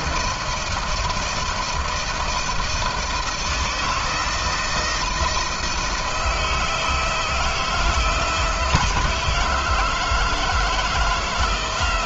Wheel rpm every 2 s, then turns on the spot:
160, 170, 160, 160, 160, 160.
none